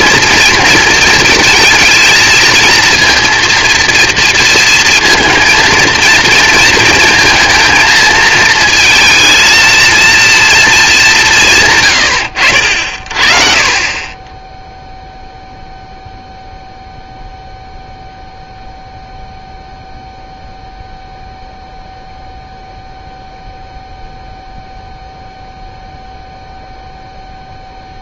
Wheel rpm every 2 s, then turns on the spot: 230, 230, 230, 220, 220, 230, 80, 10, 0, 0, 0, 0, 0, 0.
12-14